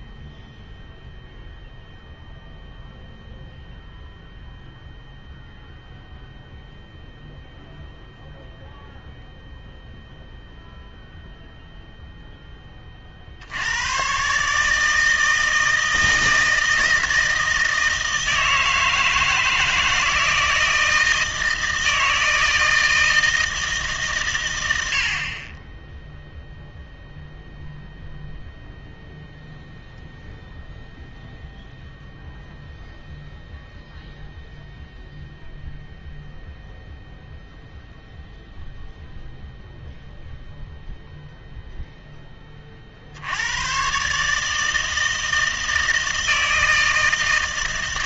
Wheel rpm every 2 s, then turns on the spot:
0, 0, 0, 0, 0, 0, 20, 150, 160, 160, 160, 160, 90, 0, 0, 0, 0, 0, 0, 0, 0, 30, 160, 160.
none